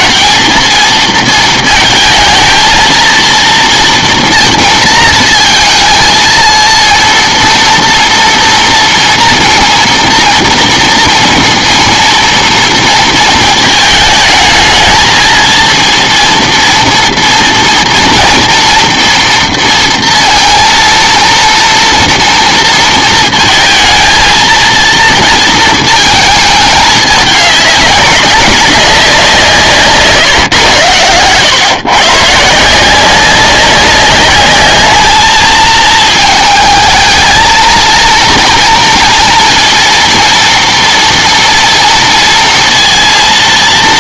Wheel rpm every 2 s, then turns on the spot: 220, 230, 230, 230, 230, 230, 230, 220, 230, 230, 230, 230, 230, 210, 200, 120, 160, 210, 220, 230, 240, 230.
none